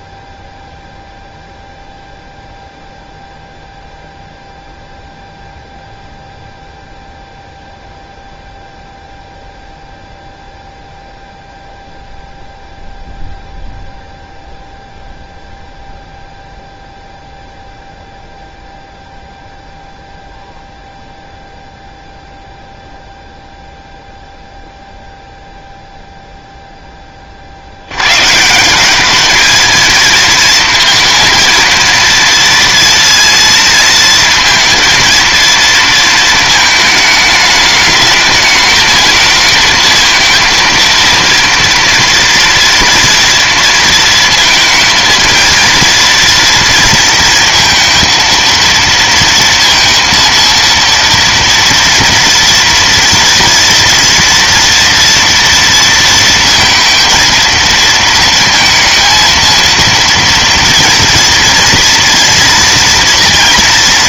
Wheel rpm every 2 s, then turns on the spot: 0, 0, 0, 0, 0, 0, 0, 0, 0, 0, 0, 0, 0, 0, 170, 230, 230, 230, 220, 210, 230, 230, 230, 230, 230, 230, 240, 230, 230, 230, 230, 230.
none